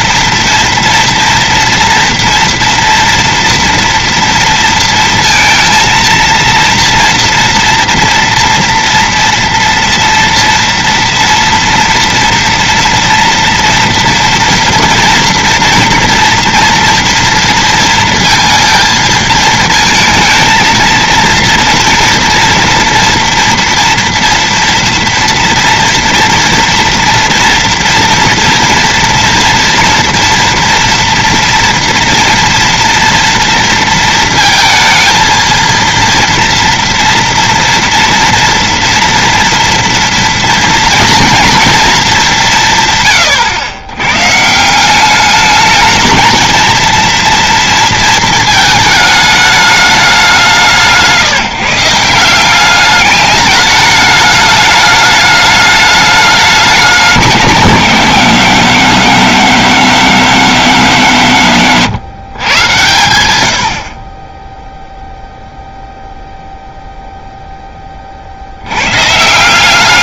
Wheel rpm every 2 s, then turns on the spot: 230, 230, 230, 230, 230, 230, 230, 230, 230, 220, 230, 230, 230, 230, 230, 230, 230, 220, 230, 230, 230, 150, 170, 230, 220, 150, 190, 210, 200, 180, 180, 120, 0, 0, 100.
none